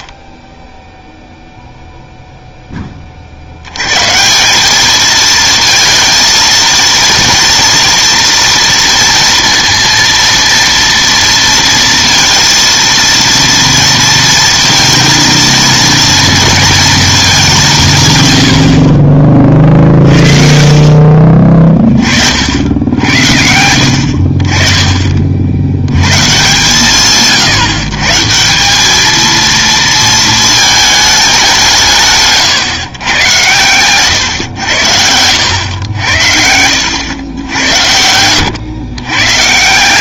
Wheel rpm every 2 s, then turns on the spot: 0, 10, 200, 230, 230, 230, 230, 230, 230, 80, 50, 60, 30, 150, 200, 220, 140, 100, 80, 120.
none